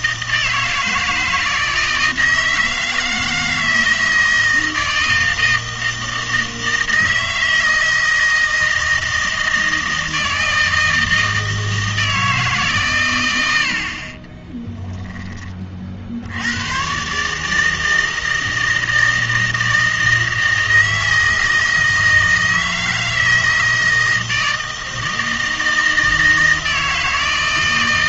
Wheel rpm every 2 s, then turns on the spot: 160, 160, 160, 160, 160, 160, 140, 10, 110, 160, 160, 160, 160, 160.
14-16